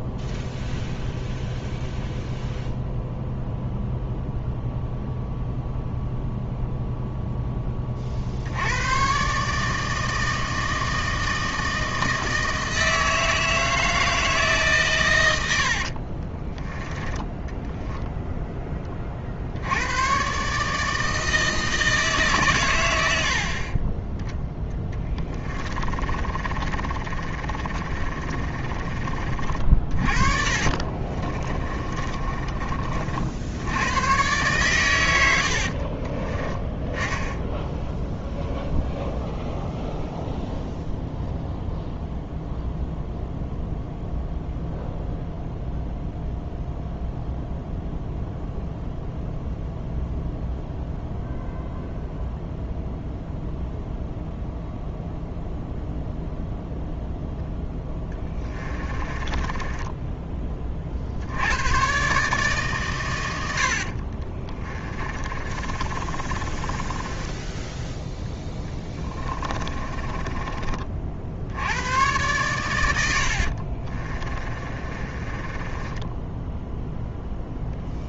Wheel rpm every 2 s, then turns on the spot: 0, 0, 0, 0, 100, 160, 160, 140, 10, 20, 150, 100, 10, 30, 30, 40, 40, 110, 10, 0, 0, 0, 0, 0, 0, 0, 0, 0, 0, 20, 40, 120, 30, 20, 20, 40, 100, 30, 0.
24-28 30-32 58-60 64-70 74-76